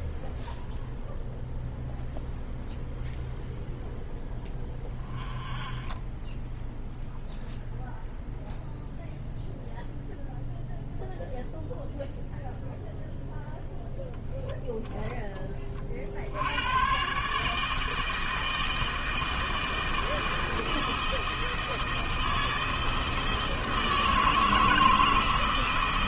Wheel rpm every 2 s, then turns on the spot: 0, 0, 0, 0, 0, 0, 0, 0, 120, 160, 160, 160, 160.
none